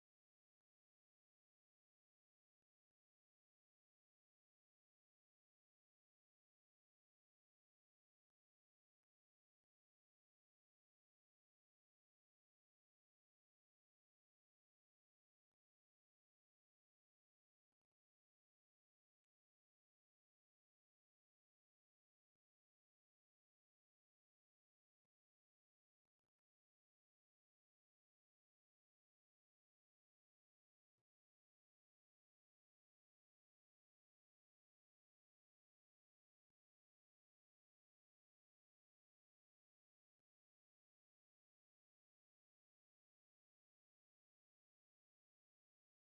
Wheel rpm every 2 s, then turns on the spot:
0, 0, 0, 0, 0, 0, 0, 0, 0, 0, 0, 0, 0, 0, 0, 0, 0, 0, 0, 0, 0, 0, 0.
none